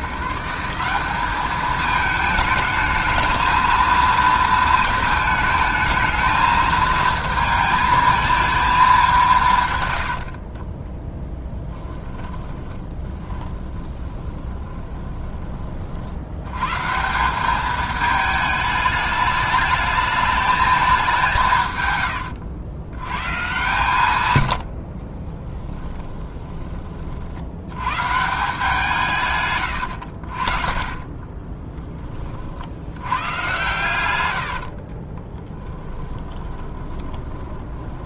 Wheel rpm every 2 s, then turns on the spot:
180, 220, 220, 220, 210, 20, 30, 20, 140, 210, 210, 100, 80, 20, 160, 30, 70, 70, 30.
12-16 24-26 30-32 34-38